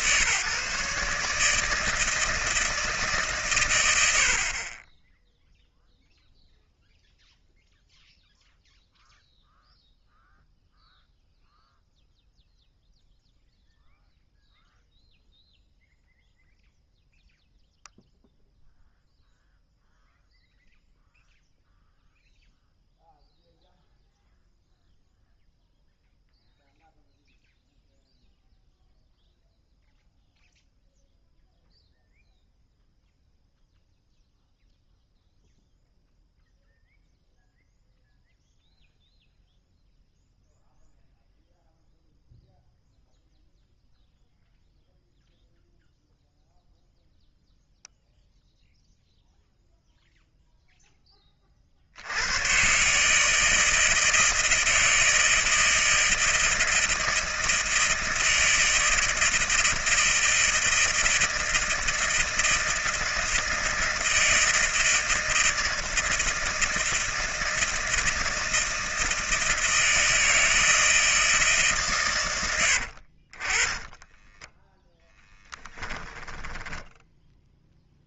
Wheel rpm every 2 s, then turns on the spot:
140, 160, 30, 0, 0, 0, 0, 0, 0, 0, 0, 0, 0, 0, 0, 0, 0, 0, 0, 0, 0, 0, 0, 0, 0, 0, 120, 160, 160, 160, 160, 160, 160, 160, 160, 160, 90, 10, 10.
72-78